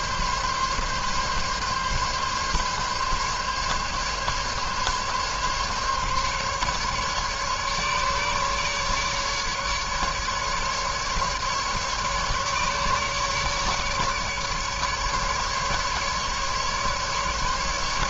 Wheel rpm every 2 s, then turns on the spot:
140, 140, 140, 140, 140, 150, 150, 150, 150.
none